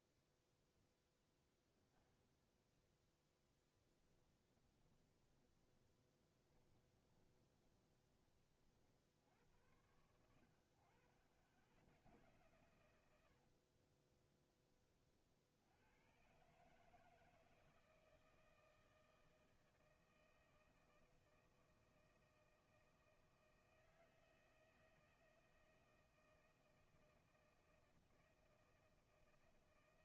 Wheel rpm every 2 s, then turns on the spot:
0, 0, 10, 20, 30, 80, 100, 40, 90, 160, 160, 160, 160, 160, 160.
4-10 14-16